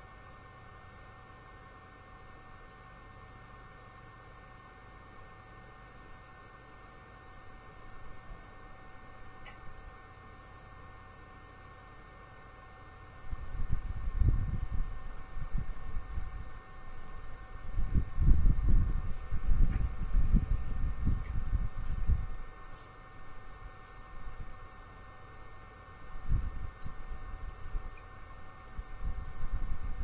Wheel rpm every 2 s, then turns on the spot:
0, 0, 0, 0, 0, 0, 0, 0, 0, 0, 0, 0, 0, 0, 0.
none